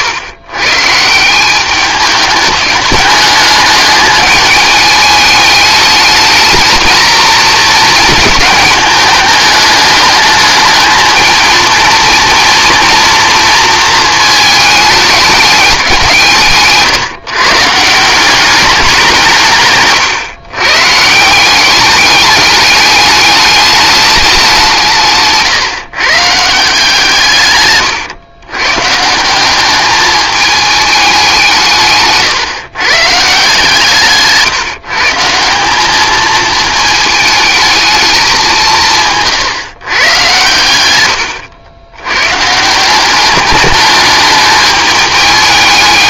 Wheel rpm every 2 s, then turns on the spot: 140, 210, 210, 220, 220, 220, 240, 220, 150, 190, 140, 210, 170, 160, 140, 200, 140, 150, 220, 180, 110, 180, 210.
none